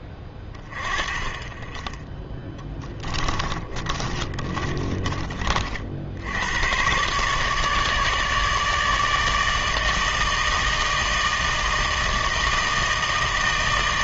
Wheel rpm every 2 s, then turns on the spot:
20, 10, 30, 100, 150, 160, 160.
2-6